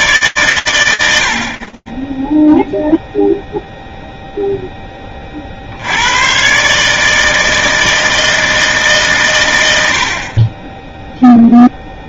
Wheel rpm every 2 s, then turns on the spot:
110, 10, 0, 130, 160, 30.
none